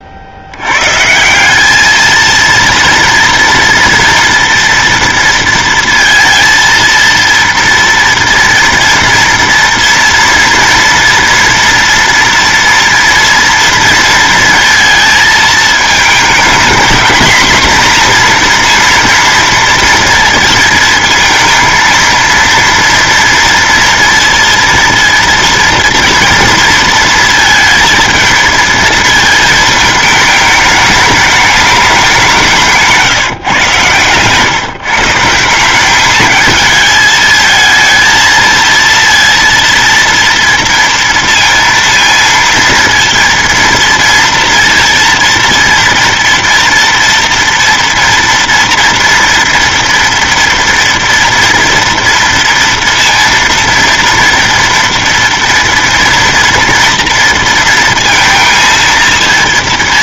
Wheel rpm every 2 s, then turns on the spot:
120, 230, 230, 230, 230, 230, 230, 220, 230, 230, 230, 230, 230, 230, 220, 210, 170, 140, 220, 230, 230, 230, 230, 230, 230, 230, 230, 230, 230, 230.
32-34